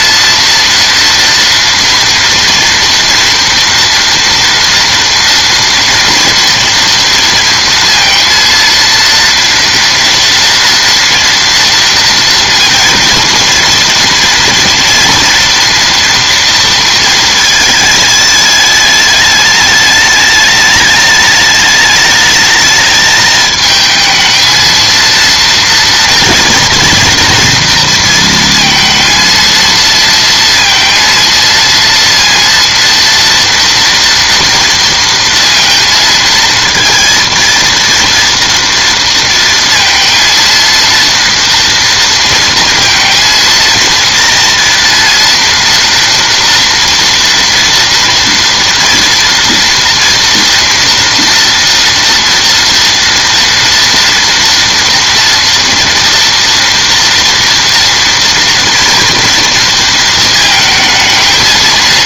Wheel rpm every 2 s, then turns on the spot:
230, 230, 230, 230, 230, 230, 240, 230, 230, 210, 210, 220, 230, 240, 230, 230, 230, 230, 230, 230, 230, 230, 230, 240, 230, 230, 230, 230, 230, 230, 220.
none